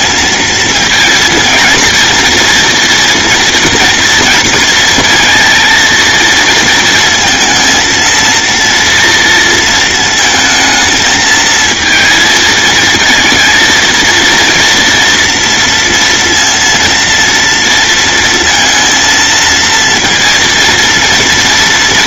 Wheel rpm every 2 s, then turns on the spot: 230, 230, 230, 220, 230, 220, 230, 230, 230, 230, 230.
none